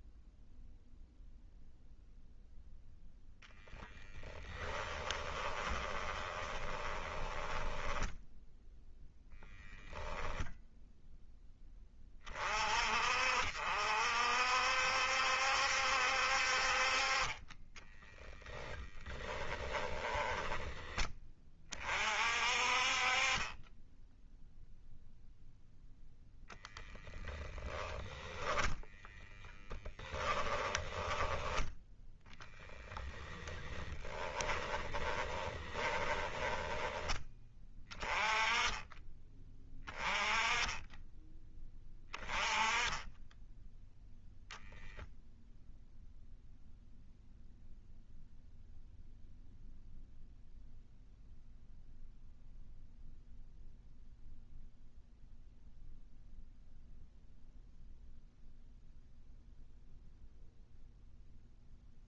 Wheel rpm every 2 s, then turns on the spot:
0, 0, 20, 20, 10, 10, 50, 70, 40, 10, 20, 40, 0, 0, 0, 10, 10, 20, 20, 20, 10, 10, 0, 0, 0, 0, 0, 0, 0, 0, 0.
4-8 18-20 30-36